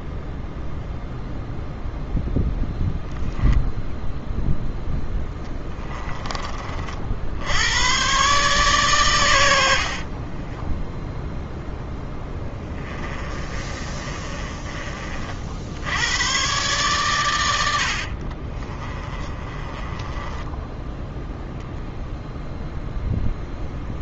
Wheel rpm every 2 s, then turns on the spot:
0, 0, 10, 50, 120, 0, 30, 30, 120, 30, 10, 0.
12-14 18-22